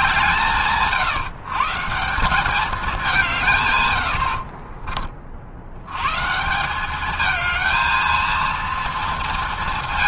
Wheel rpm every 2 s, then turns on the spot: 150, 140, 50, 220, 230.
none